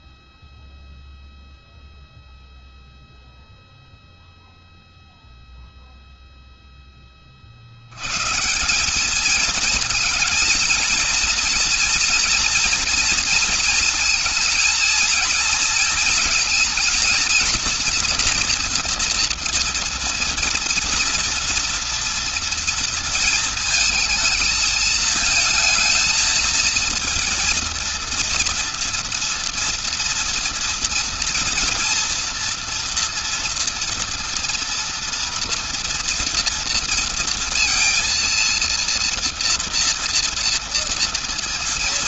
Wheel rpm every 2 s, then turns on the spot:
0, 0, 0, 0, 160, 230, 230, 230, 230, 230, 230, 230, 220, 220, 230, 230, 240, 230, 230, 230, 230.
none